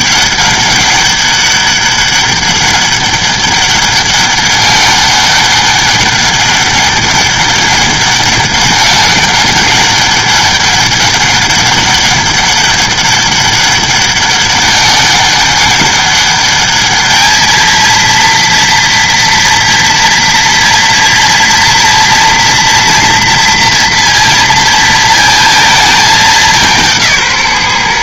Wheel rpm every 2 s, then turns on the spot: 200, 200, 200, 200, 200, 200, 200, 200, 210, 230, 240, 230, 230, 180.
none